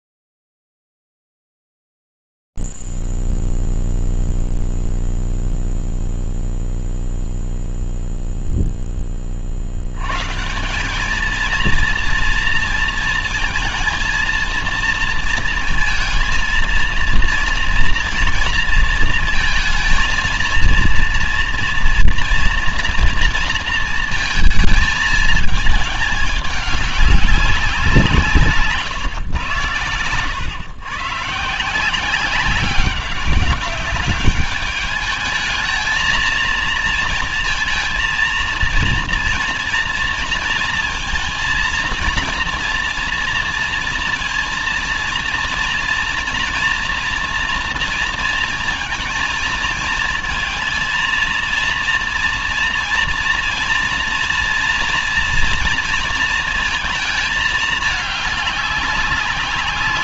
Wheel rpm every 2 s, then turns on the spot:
0, 0, 0, 0, 0, 70, 230, 230, 230, 230, 230, 230, 230, 210, 170, 110, 190, 200, 230, 230, 230, 230, 230, 230, 230, 220, 230, 230, 220, 200.
none